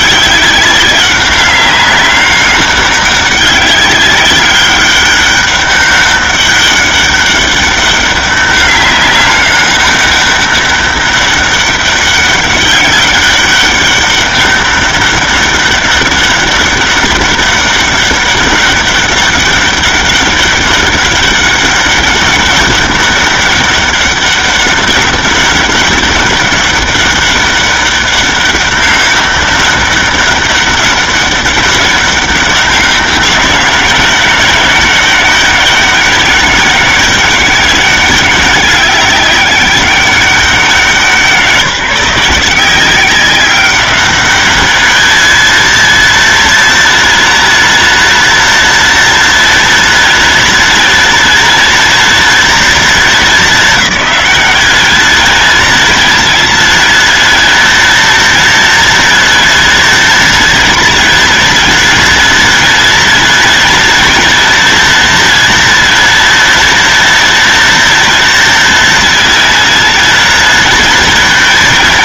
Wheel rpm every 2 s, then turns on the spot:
200, 200, 200, 200, 200, 200, 200, 200, 200, 200, 200, 200, 200, 200, 200, 200, 200, 190, 200, 200, 190, 180, 210, 230, 230, 230, 230, 200, 230, 230, 230, 230, 240, 230, 230, 230.
none